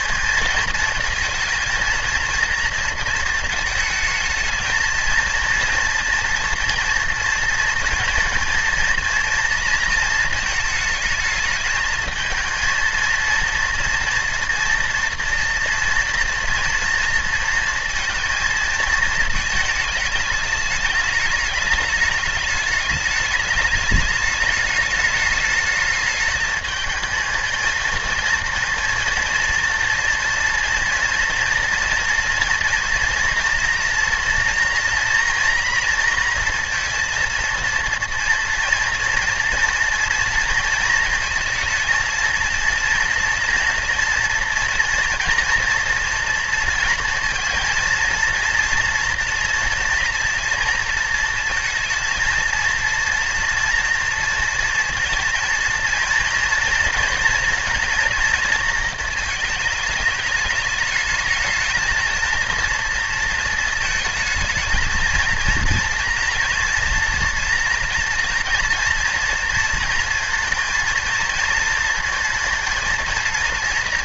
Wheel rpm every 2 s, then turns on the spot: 220, 230, 220, 230, 230, 220, 230, 230, 230, 220, 210, 210, 210, 220, 230, 230, 230, 230, 230, 230, 230, 230, 230, 230, 240, 230, 230, 230, 230, 230, 210, 230, 230, 230, 240, 220, 230.
none